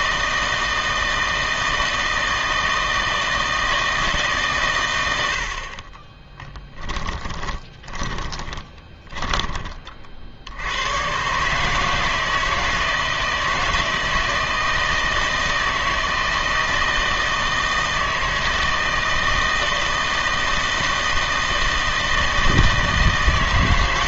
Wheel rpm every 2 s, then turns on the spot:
160, 160, 120, 10, 20, 90, 160, 160, 160, 160, 160, 160.
6-10